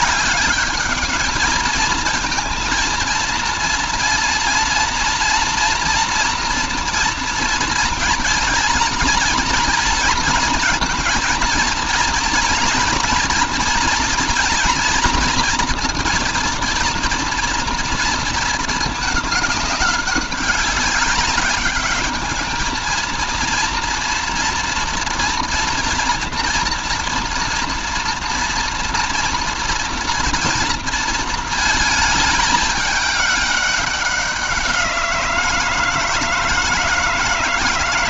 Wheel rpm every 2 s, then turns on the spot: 200, 230, 230, 230, 230, 230, 230, 230, 230, 220, 200, 220, 230, 240, 240, 230, 210, 180, 160.
none